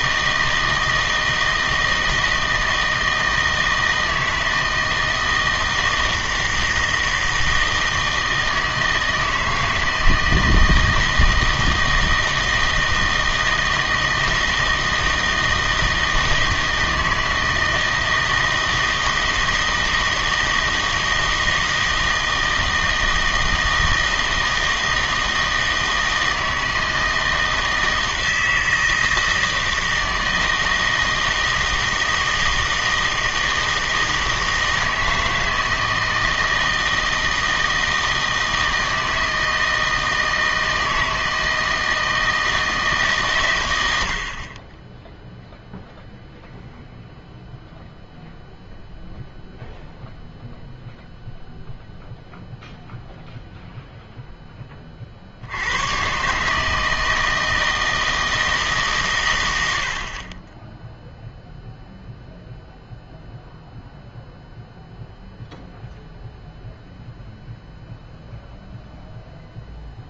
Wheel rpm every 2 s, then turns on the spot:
160, 160, 160, 160, 160, 160, 160, 160, 160, 160, 160, 160, 160, 160, 160, 160, 160, 160, 160, 160, 160, 160, 20, 0, 0, 0, 0, 30, 160, 150, 10, 0, 0, 0, 0.
none